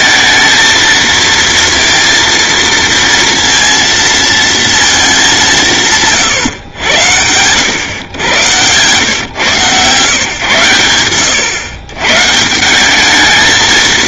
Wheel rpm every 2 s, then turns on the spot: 230, 230, 220, 100, 120, 110, 200.
none